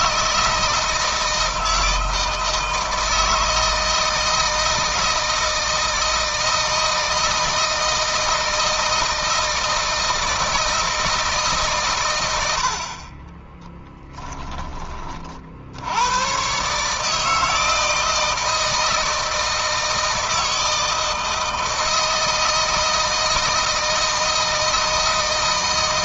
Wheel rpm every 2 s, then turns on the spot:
160, 160, 160, 160, 160, 160, 70, 20, 130, 160, 160, 160, 160.
none